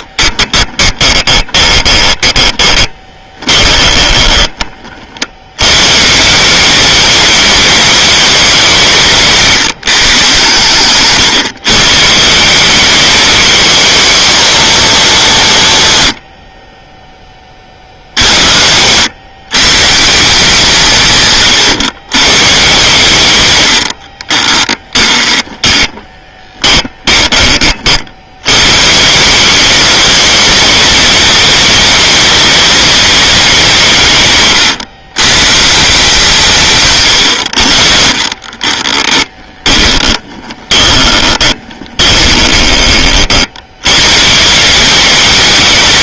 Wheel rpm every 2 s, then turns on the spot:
10, 30, 40, 200, 200, 130, 170, 210, 60, 80, 170, 130, 20, 20, 120, 230, 210, 130, 160, 40, 20, 20, 160.
0-4 24-28 34-36 38-44